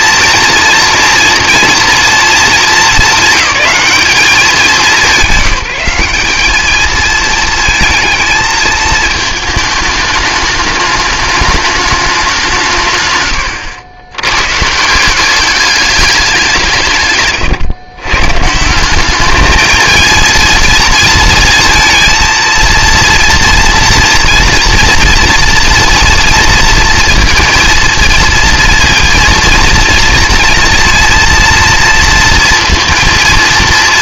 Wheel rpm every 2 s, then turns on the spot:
240, 220, 190, 210, 220, 210, 140, 150, 160, 180, 230, 230, 240, 230, 230, 240, 230.
none